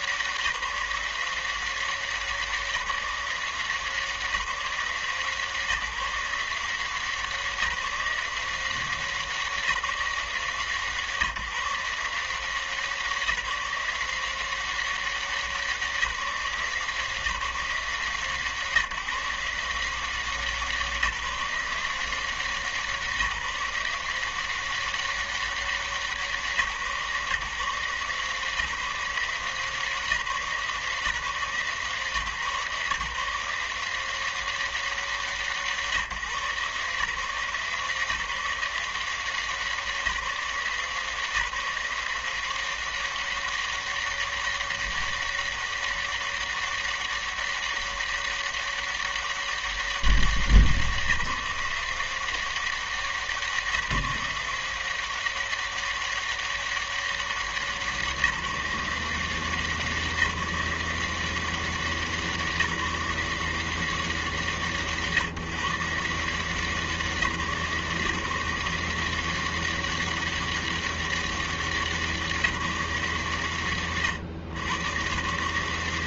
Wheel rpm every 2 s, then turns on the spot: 180, 180, 180, 170, 180, 170, 160, 170, 180, 150, 160, 170, 170, 170, 150, 170, 140, 180, 150, 170, 170, 180, 200, 200, 200, 190, 170, 180, 200, 170, 180, 180, 170, 160, 150, 200, 190, 110.
none